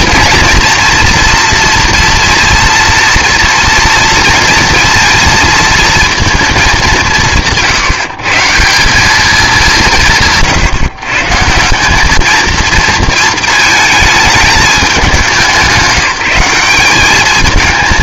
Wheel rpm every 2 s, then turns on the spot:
230, 230, 230, 210, 160, 160, 230, 210, 190.
none